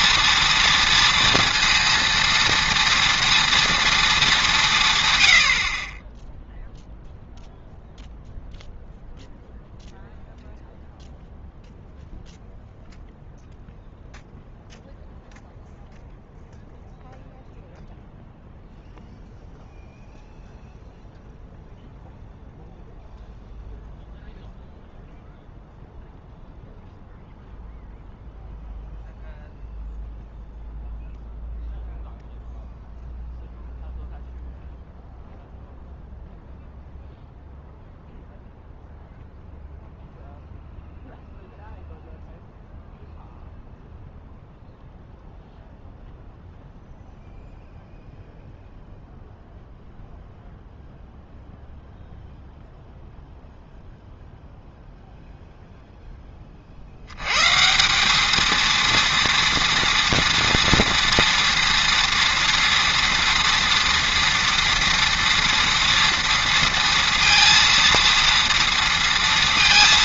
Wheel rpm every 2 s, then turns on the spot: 230, 230, 180, 0, 0, 0, 0, 0, 0, 0, 0, 0, 0, 0, 0, 0, 0, 0, 0, 0, 0, 0, 0, 0, 0, 0, 0, 0, 40, 230, 230, 230, 230, 230, 230.
none